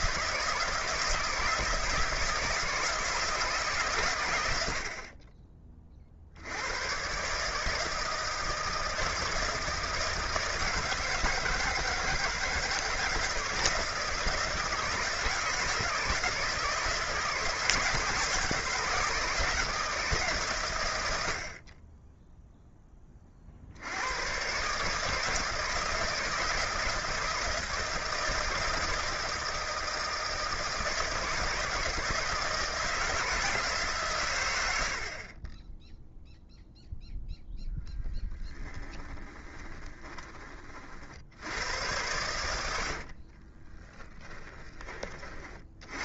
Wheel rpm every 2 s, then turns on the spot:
160, 160, 60, 110, 160, 160, 160, 160, 160, 160, 100, 20, 150, 160, 160, 160, 160, 60, 0, 20, 50, 70, 20.
38-40 42-44